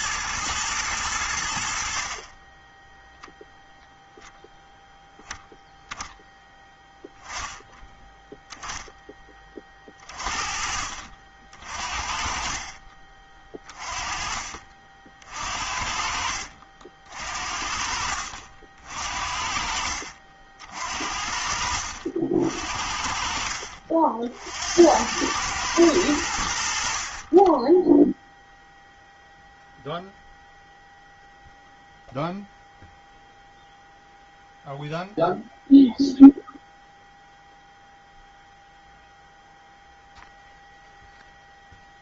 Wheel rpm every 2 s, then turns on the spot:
110, 10, 0, 10, 10, 40, 30, 50, 50, 60, 60, 50, 80, 60, 0, 0, 0, 0, 0, 0, 0.
none